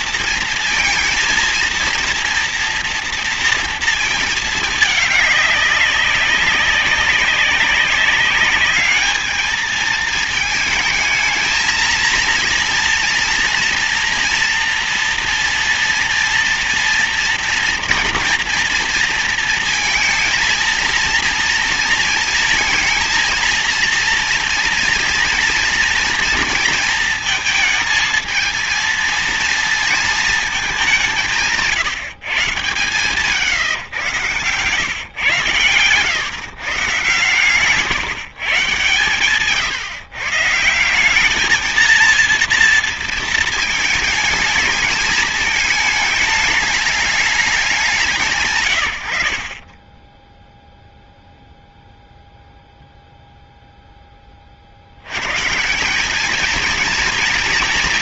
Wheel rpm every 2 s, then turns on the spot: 230, 230, 220, 190, 200, 220, 230, 230, 230, 230, 230, 230, 240, 230, 230, 210, 130, 130, 140, 130, 140, 230, 220, 210, 140, 0, 0, 40, 210.
none